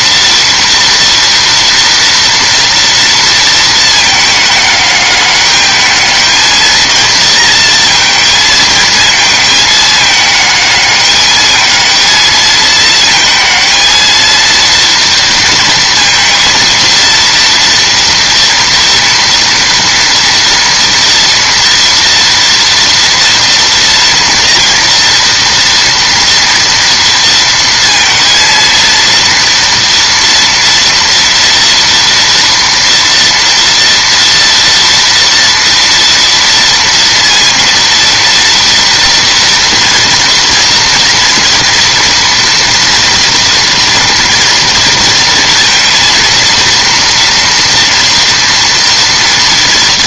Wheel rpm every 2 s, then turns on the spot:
230, 230, 210, 230, 220, 210, 220, 230, 230, 230, 240, 230, 230, 230, 230, 230, 230, 230, 230, 230, 230, 230, 230, 230, 230.
none